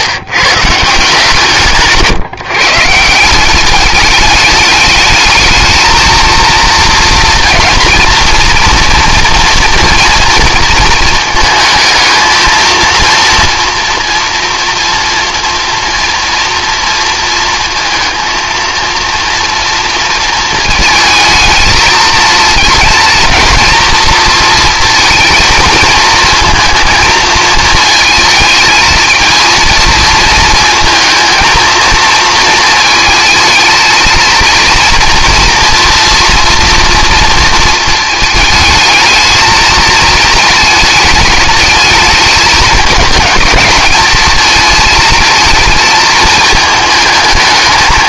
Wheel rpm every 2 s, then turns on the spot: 150, 150, 210, 230, 230, 220, 230, 240, 230, 230, 230, 230, 230, 220, 220, 220, 220, 230, 230, 220, 220, 220, 220, 220.
none